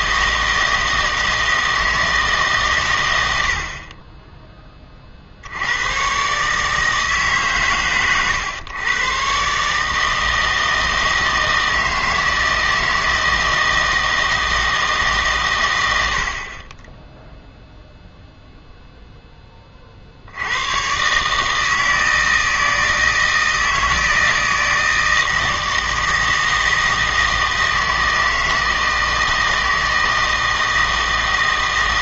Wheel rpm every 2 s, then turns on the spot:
160, 140, 20, 150, 120, 160, 160, 160, 40, 0, 100, 160, 160, 160, 160, 160.
none